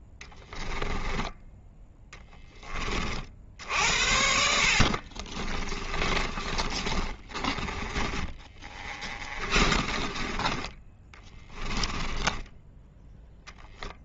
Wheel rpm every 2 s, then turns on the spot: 10, 10, 60, 30, 40, 30, 10.
6-14